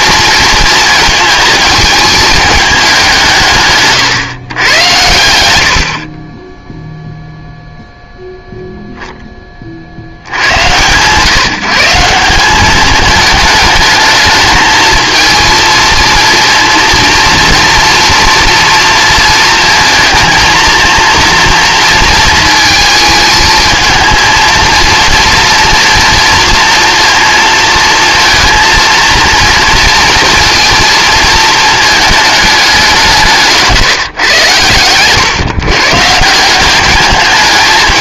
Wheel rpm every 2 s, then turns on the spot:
220, 200, 110, 10, 0, 100, 200, 220, 240, 230, 230, 220, 230, 230, 230, 230, 190, 110, 200.
none